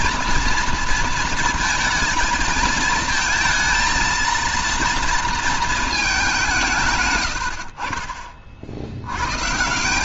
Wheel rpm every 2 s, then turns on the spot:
230, 220, 230, 150, 60.
none